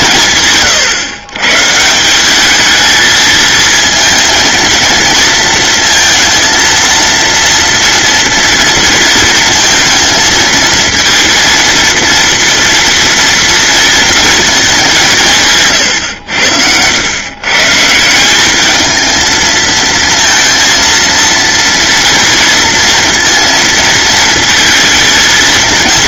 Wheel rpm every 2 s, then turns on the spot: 130, 220, 230, 230, 230, 230, 230, 190, 100, 220, 230, 230, 230.
none